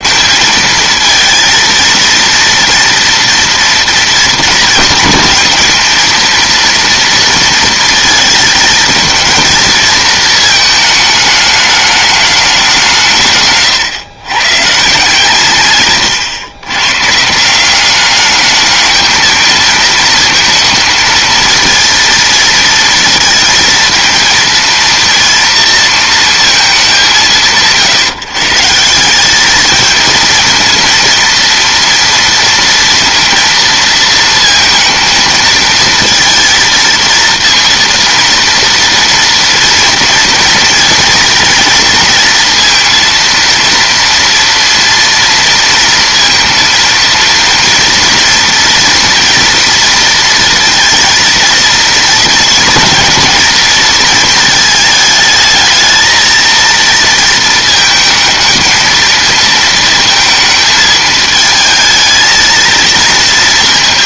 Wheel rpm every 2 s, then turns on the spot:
220, 230, 220, 230, 220, 220, 190, 140, 120, 210, 230, 230, 220, 200, 160, 230, 230, 230, 230, 230, 230, 230, 230, 230, 240, 230, 230, 220, 230, 220, 220, 230.
none